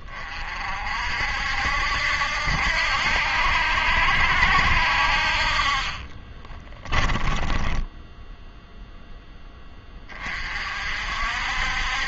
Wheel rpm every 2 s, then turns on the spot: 40, 70, 70, 20, 0, 50.
6-8